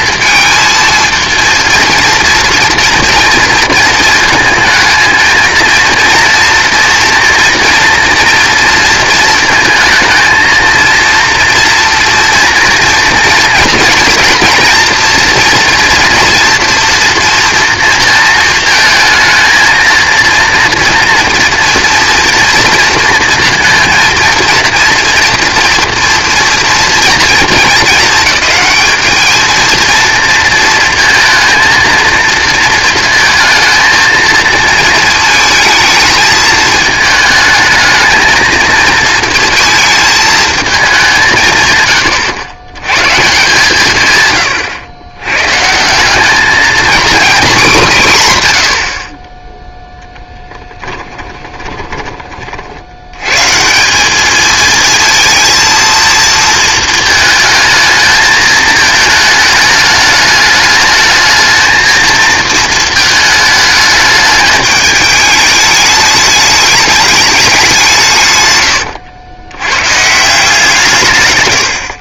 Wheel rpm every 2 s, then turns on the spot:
230, 230, 220, 240, 230, 230, 230, 240, 230, 220, 230, 230, 230, 230, 220, 220, 220, 230, 220, 230, 210, 100, 110, 220, 100, 10, 50, 220, 220, 220, 210, 230, 210, 210, 120, 170.
50-52